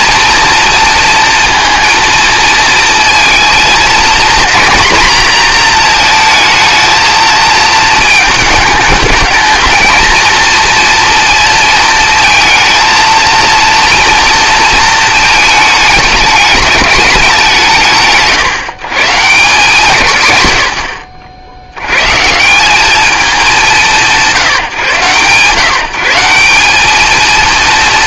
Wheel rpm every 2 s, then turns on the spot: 230, 230, 240, 220, 210, 230, 220, 230, 200, 120, 130, 170, 140, 190.
none